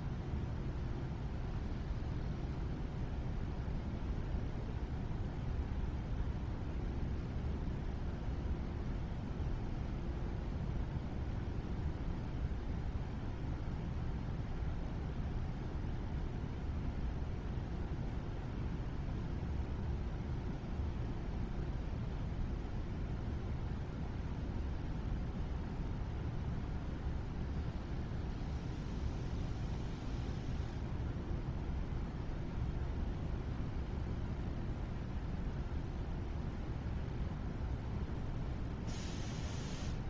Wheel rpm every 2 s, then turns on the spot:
0, 0, 0, 0, 0, 0, 0, 0, 0, 0, 0, 0, 0, 0, 0, 0, 0, 0, 0, 0.
none